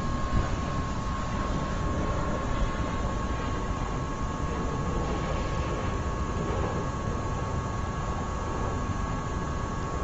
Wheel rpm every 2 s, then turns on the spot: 0, 0, 0, 0, 0.
none